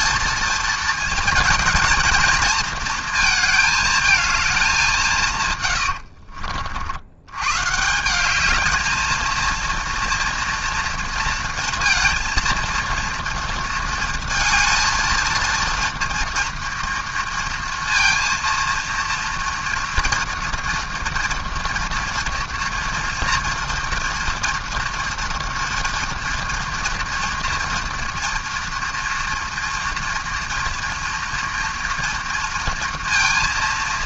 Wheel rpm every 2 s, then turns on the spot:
230, 230, 180, 70, 220, 230, 230, 220, 230, 230, 230, 240, 230, 230, 230, 230, 230.
none